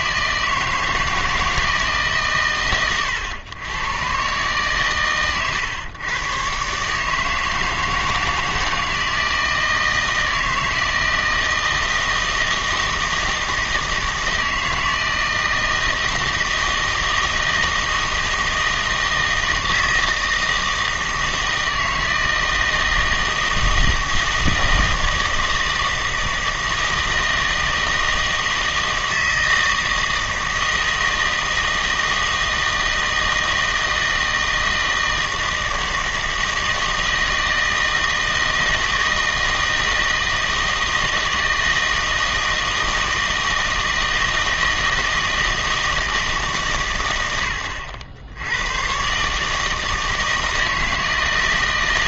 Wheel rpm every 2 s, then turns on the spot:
160, 120, 130, 140, 160, 160, 160, 160, 160, 160, 160, 160, 160, 160, 160, 160, 160, 160, 160, 160, 160, 160, 160, 130, 120, 160.
none